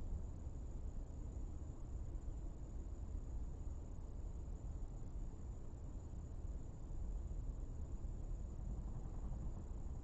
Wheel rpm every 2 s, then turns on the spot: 0, 0, 0, 0, 0.
none